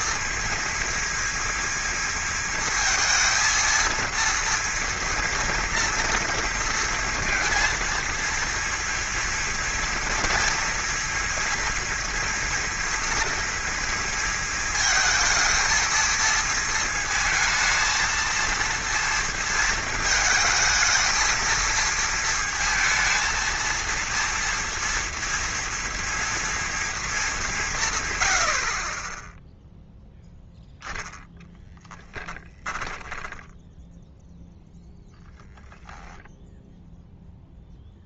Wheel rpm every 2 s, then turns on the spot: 230, 230, 230, 230, 230, 230, 230, 220, 220, 230, 220, 230, 230, 230, 50, 0, 10, 0, 0.
32-34